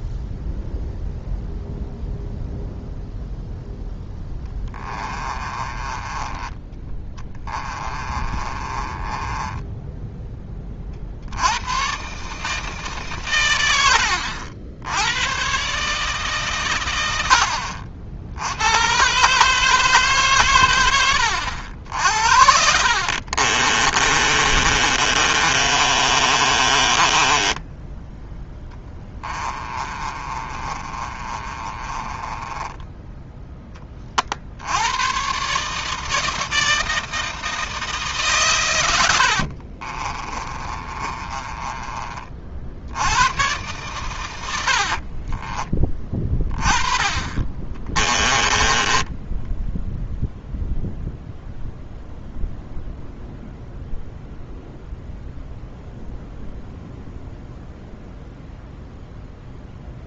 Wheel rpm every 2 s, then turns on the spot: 0, 0, 20, 20, 20, 30, 150, 80, 120, 110, 100, 50, 30, 20, 10, 30, 10, 90, 160, 100, 30, 60, 60, 30, 10, 0, 0, 0, 0, 0.
4-6 8-10 22-34 40-42 44-46 48-50